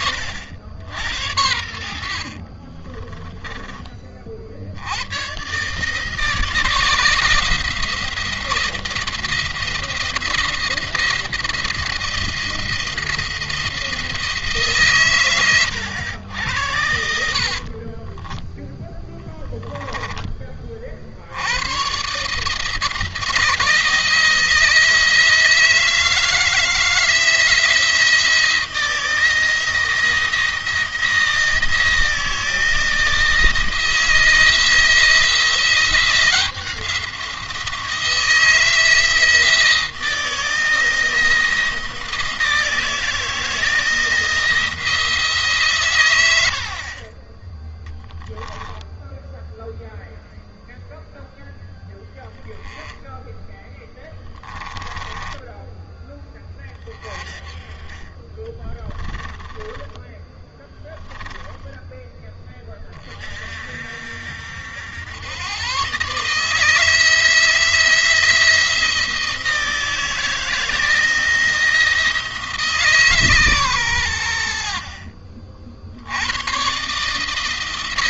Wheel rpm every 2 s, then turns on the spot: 80, 30, 80, 160, 170, 160, 170, 140, 80, 10, 40, 160, 160, 160, 170, 160, 170, 170, 180, 160, 160, 160, 160, 50, 0, 0, 10, 20, 20, 20, 20, 20, 80, 160, 170, 160, 150, 50, 140.
2-4 16-20 52-56 58-62